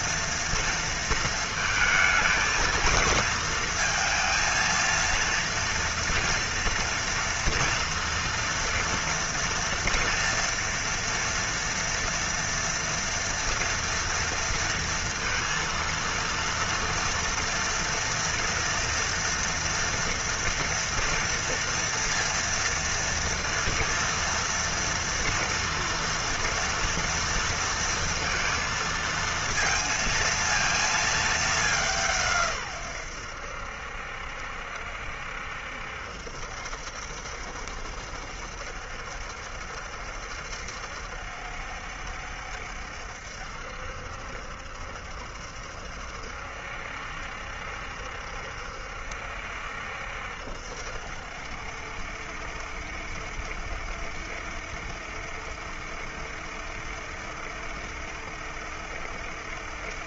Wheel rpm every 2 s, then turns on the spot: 230, 220, 230, 230, 230, 230, 230, 230, 230, 230, 240, 230, 230, 230, 230, 230, 150, 70, 70, 70, 70, 70, 70, 70, 70, 70, 70, 70, 70, 70.
none